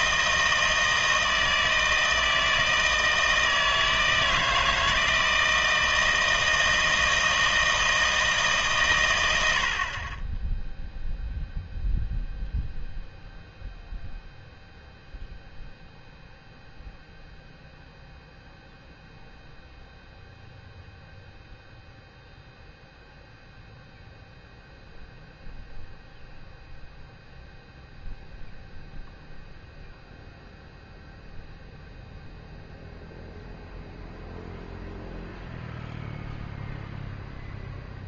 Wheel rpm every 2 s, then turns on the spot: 160, 160, 160, 160, 140, 10, 0, 0, 0, 0, 0, 0, 0, 0, 0, 0, 0, 0, 0.
none